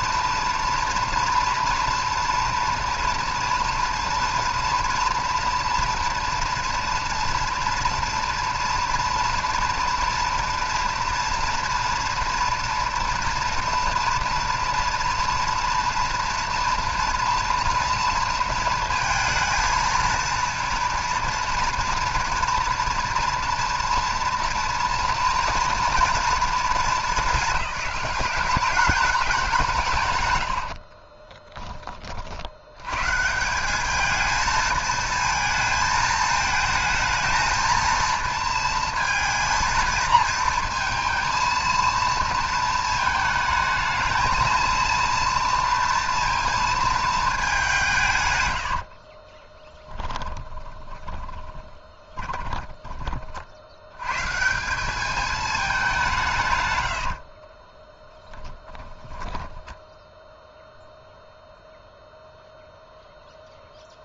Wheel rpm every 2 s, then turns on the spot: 230, 230, 230, 230, 230, 230, 230, 230, 230, 230, 230, 230, 230, 210, 190, 70, 100, 220, 220, 230, 230, 230, 230, 230, 80, 20, 30, 150, 90, 10, 0, 0.
30-32 48-54 56-60